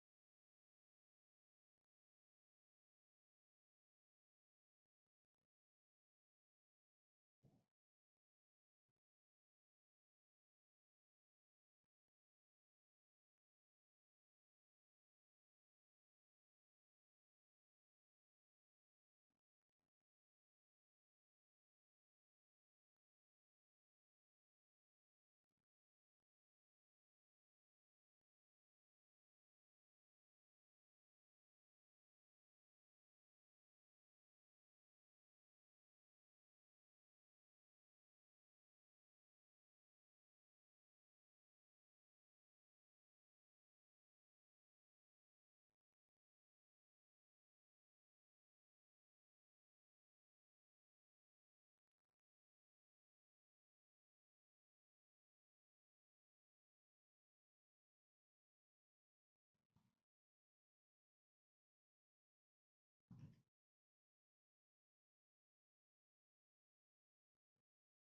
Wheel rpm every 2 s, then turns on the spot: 0, 0, 0, 0, 0, 0, 0, 0, 0, 0, 0, 0, 0, 0, 0, 0, 0, 0, 0, 0, 0, 0, 0, 0, 0, 0, 0, 0, 0, 0, 0, 0, 0, 0.
none